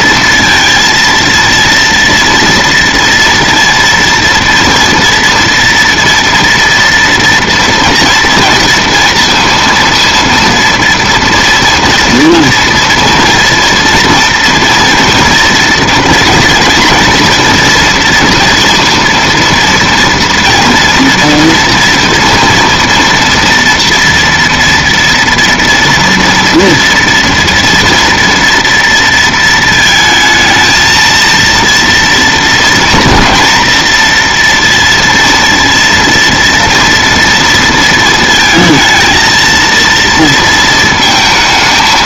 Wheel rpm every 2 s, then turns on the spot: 230, 230, 230, 230, 230, 230, 230, 230, 230, 230, 240, 230, 240, 240, 230, 220, 230, 240, 230, 230, 230.
none